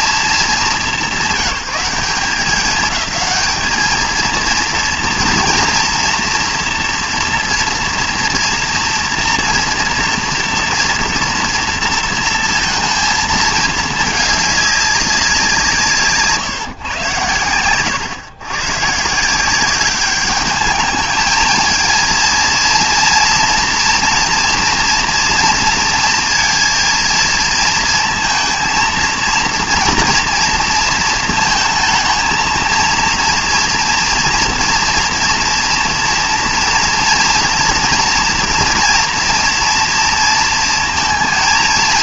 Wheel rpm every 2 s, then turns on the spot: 200, 210, 230, 230, 230, 230, 230, 210, 140, 120, 210, 230, 240, 230, 220, 230, 230, 230, 230, 240, 230.
none